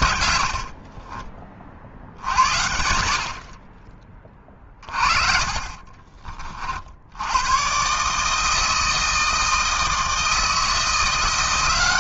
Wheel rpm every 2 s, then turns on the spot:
60, 70, 30, 50, 160, 160.
0-2